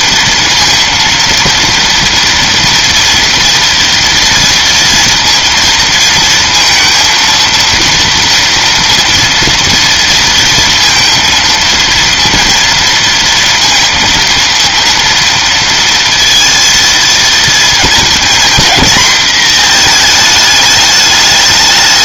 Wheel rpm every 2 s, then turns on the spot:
230, 230, 240, 230, 230, 230, 230, 230, 230, 240, 210.
none